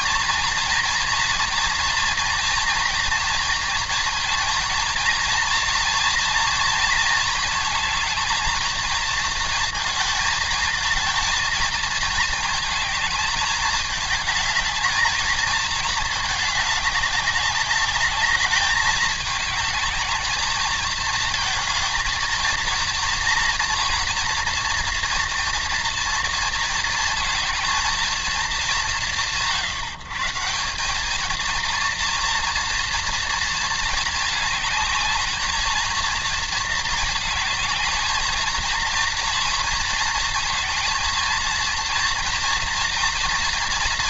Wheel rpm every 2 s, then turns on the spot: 230, 230, 230, 230, 230, 220, 220, 220, 210, 210, 220, 230, 230, 230, 190, 200, 230, 220, 220, 230, 220, 230.
none